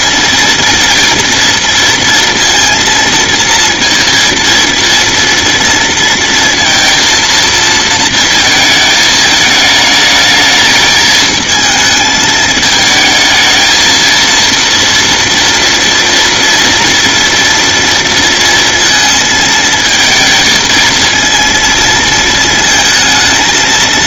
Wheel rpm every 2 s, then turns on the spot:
230, 230, 230, 230, 220, 220, 220, 230, 230, 230, 220, 230.
none